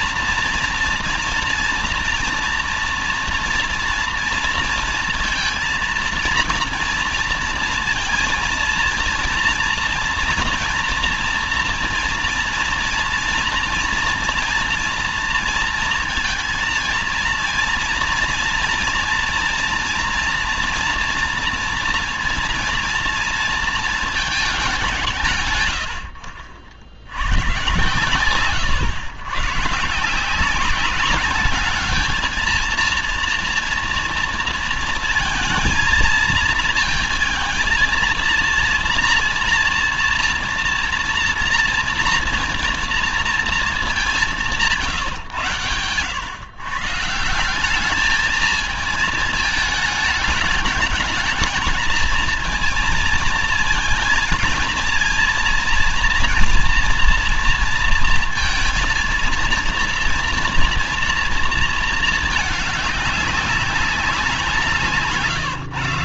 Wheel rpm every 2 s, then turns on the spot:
230, 230, 230, 230, 230, 230, 230, 240, 230, 230, 240, 230, 200, 70, 110, 190, 230, 230, 220, 230, 230, 230, 150, 130, 220, 210, 230, 230, 230, 230, 230, 210, 170.
none